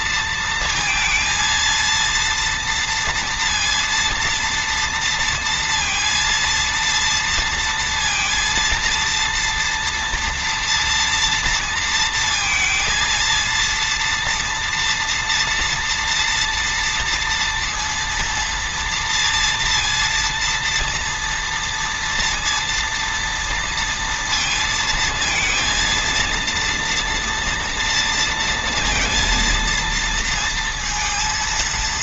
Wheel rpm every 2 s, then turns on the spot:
230, 230, 230, 230, 230, 230, 230, 230, 230, 230, 230, 230, 220, 230, 230, 230.
none